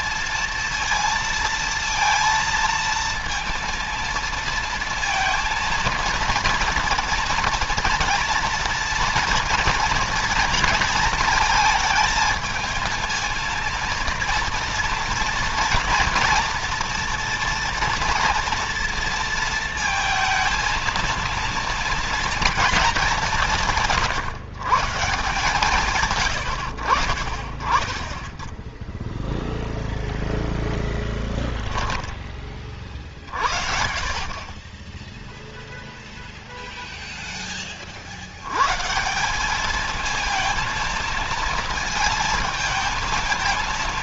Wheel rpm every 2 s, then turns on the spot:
230, 230, 230, 230, 230, 230, 230, 230, 230, 240, 230, 230, 150, 90, 10, 0, 30, 40, 0, 110, 230, 220.
none